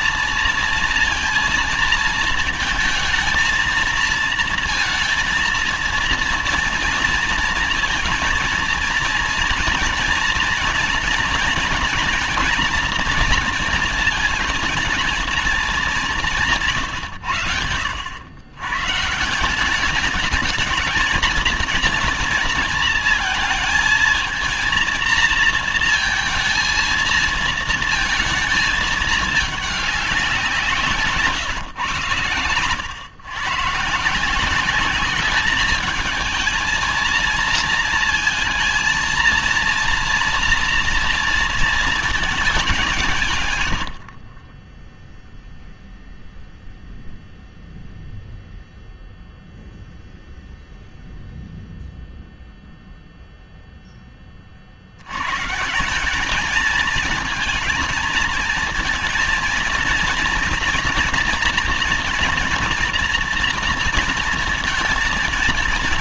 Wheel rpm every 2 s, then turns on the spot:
230, 220, 220, 230, 230, 230, 230, 230, 170, 100, 210, 230, 230, 220, 220, 190, 120, 170, 220, 230, 230, 200, 30, 0, 0, 0, 0, 30, 210, 230, 230, 240, 230.
none